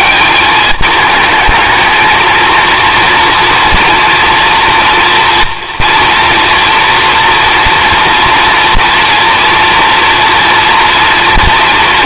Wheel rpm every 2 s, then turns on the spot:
210, 230, 230, 240, 240, 230.
none